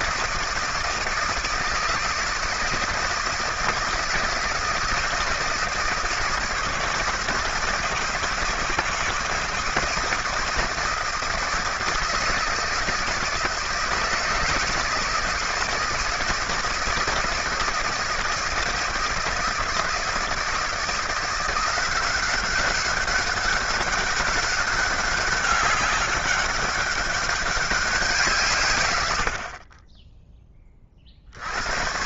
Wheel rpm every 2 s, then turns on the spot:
160, 160, 160, 160, 160, 160, 160, 160, 160, 160, 160, 190, 190, 190, 130, 20.
none